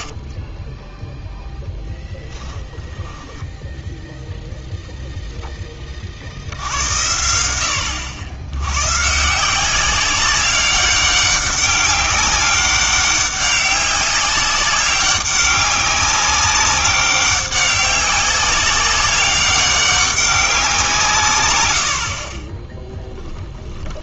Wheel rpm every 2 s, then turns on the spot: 10, 10, 0, 80, 110, 200, 190, 200, 200, 190, 180, 10.
0-4 22-24